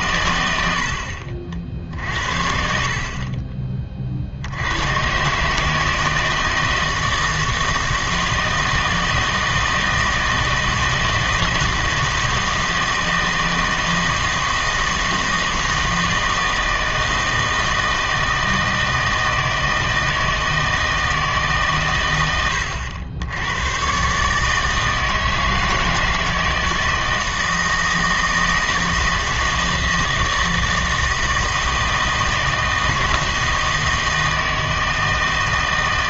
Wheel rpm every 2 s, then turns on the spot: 90, 60, 80, 160, 160, 160, 160, 160, 160, 160, 160, 100, 150, 160, 160, 160, 160, 160.
none